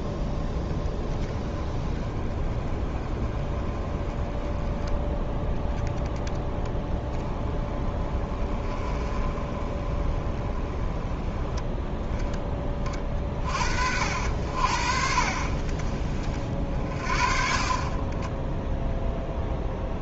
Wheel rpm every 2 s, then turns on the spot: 10, 30, 10, 20, 20, 20, 30, 60, 40, 0.
none